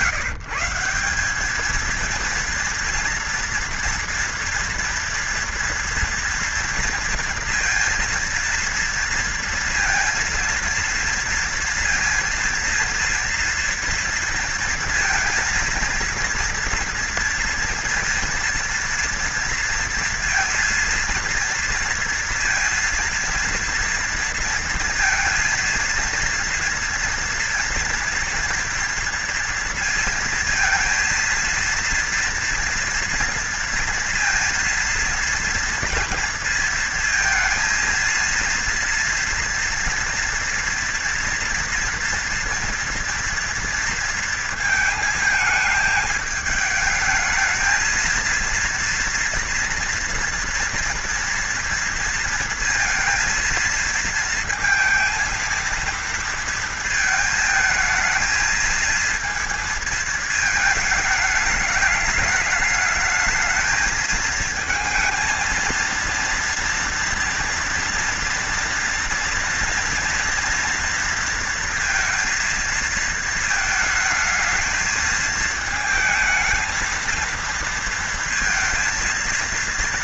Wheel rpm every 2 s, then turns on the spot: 150, 230, 230, 230, 230, 230, 230, 230, 230, 230, 230, 230, 230, 230, 230, 230, 230, 230, 230, 230, 230, 230, 230, 210, 230, 230, 230, 230, 230, 220, 220, 220, 220, 230, 230, 240, 230, 220, 220, 230.
none